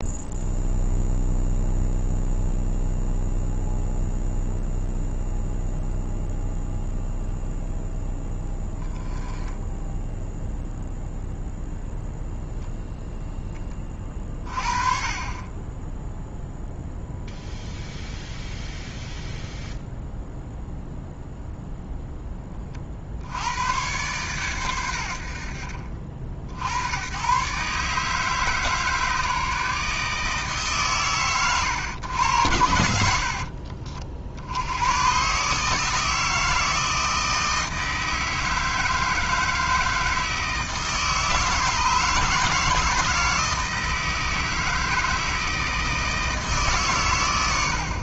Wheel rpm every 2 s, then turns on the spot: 0, 0, 0, 0, 10, 0, 0, 30, 0, 0, 0, 40, 110, 80, 150, 130, 80, 100, 160, 160, 160, 160, 160, 140.
none